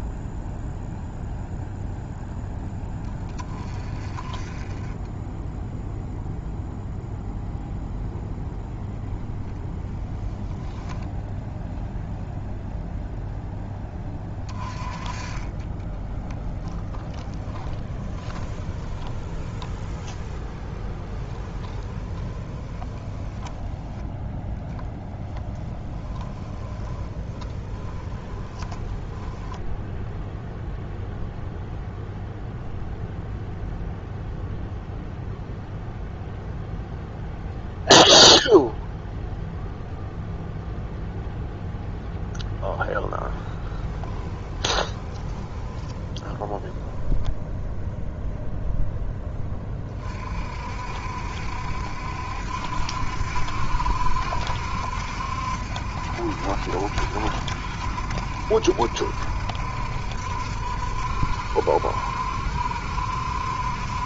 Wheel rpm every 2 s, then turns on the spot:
0, 10, 20, 0, 0, 0, 0, 20, 10, 10, 10, 10, 0, 10, 10, 0, 0, 0, 0, 0, 0, 0, 10, 0, 10, 60, 60, 70, 60, 60, 60, 60.
16-24 26-30 44-46